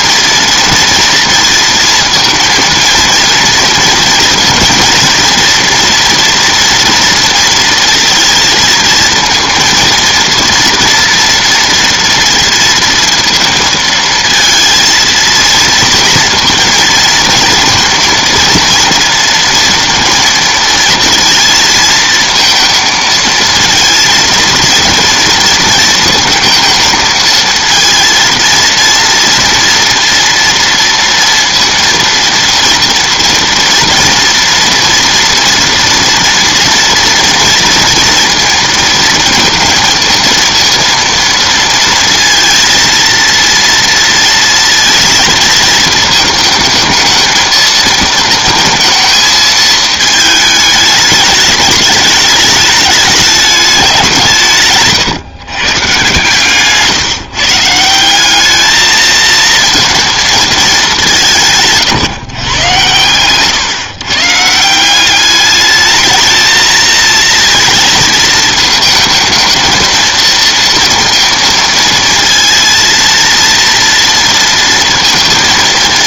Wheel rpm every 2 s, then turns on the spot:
230, 230, 240, 240, 230, 230, 230, 220, 230, 230, 220, 230, 230, 220, 230, 230, 230, 230, 230, 230, 230, 230, 230, 220, 230, 210, 210, 140, 140, 220, 210, 120, 170, 230, 220, 230, 230, 230.
none